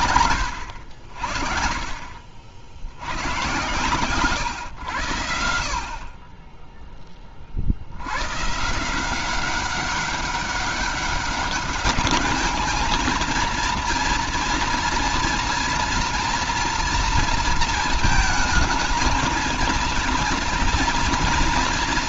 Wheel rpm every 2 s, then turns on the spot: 60, 110, 70, 30, 190, 200, 230, 230, 230, 230, 240.
none